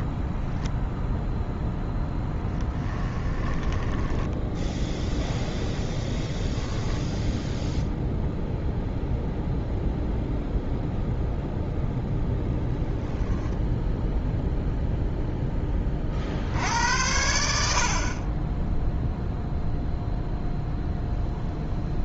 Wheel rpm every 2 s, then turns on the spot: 0, 10, 0, 0, 0, 0, 0, 0, 80, 0, 0.
2-4